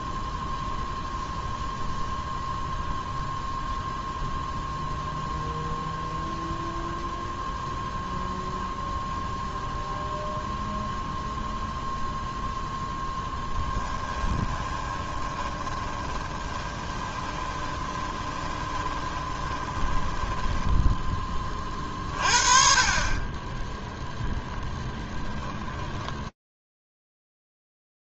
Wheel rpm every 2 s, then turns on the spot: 0, 0, 0, 0, 0, 0, 10, 20, 20, 20, 10, 50, 10, 0.
12-22 24-26